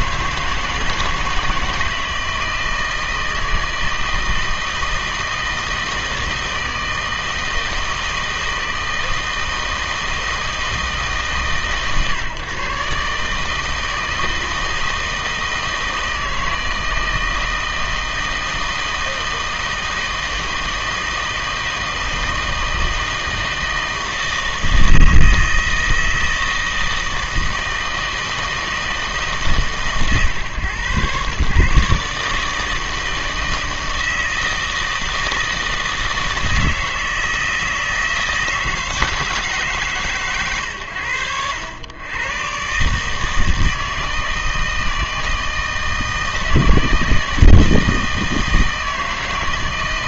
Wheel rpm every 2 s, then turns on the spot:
160, 160, 160, 160, 160, 160, 130, 160, 160, 160, 160, 160, 160, 160, 160, 110, 160, 160, 160, 160, 110, 140, 160, 160, 160.
none